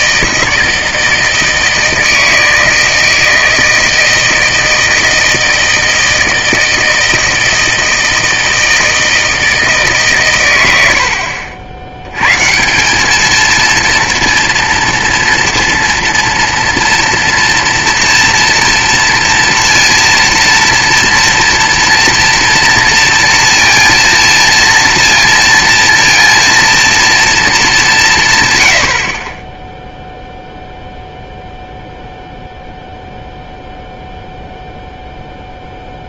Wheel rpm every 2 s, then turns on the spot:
160, 160, 160, 160, 160, 90, 190, 230, 230, 230, 230, 230, 230, 230, 100, 0, 0, 0.
none